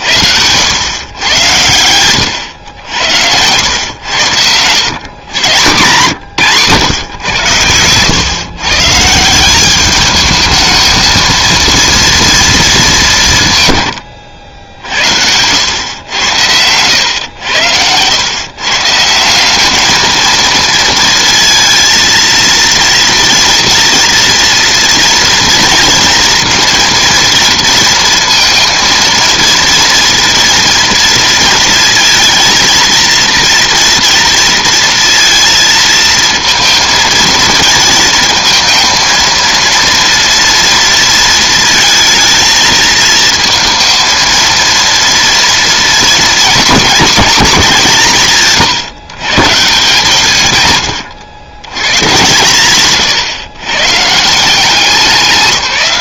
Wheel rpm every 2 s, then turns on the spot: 100, 90, 100, 130, 140, 220, 220, 70, 100, 130, 230, 230, 230, 230, 230, 230, 230, 230, 230, 220, 230, 230, 230, 230, 150, 130, 140, 170.
52-54